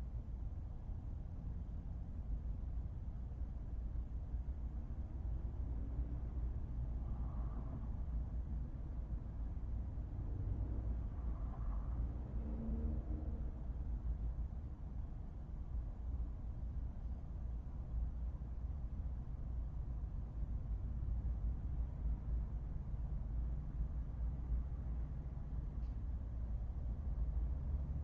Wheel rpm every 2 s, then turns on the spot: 0, 0, 0, 0, 0, 0, 0, 0, 0, 0, 0, 0, 0, 0.
none